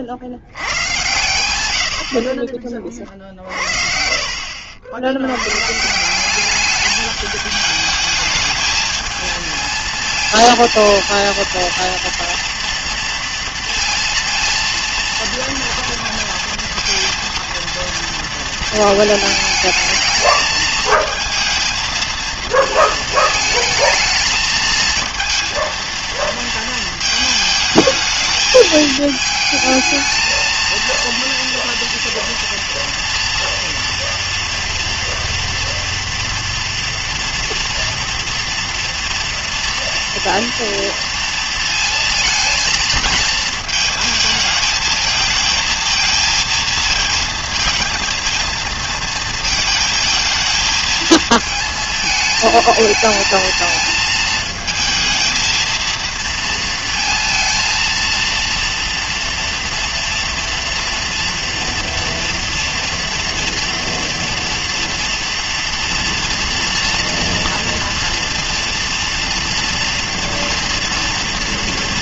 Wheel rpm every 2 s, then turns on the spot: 100, 30, 70, 200, 220, 220, 230, 230, 230, 220, 220, 230, 220, 230, 220, 230, 230, 230, 230, 240, 230, 230, 220, 230, 230, 220, 220, 230, 230, 230, 230, 230, 230, 230, 240, 230.
none